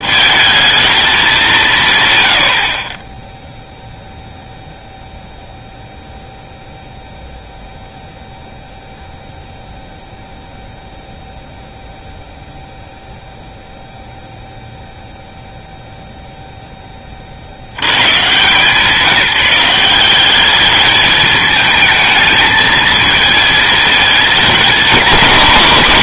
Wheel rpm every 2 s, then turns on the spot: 220, 50, 0, 0, 0, 0, 0, 0, 10, 160, 210, 220, 230.
none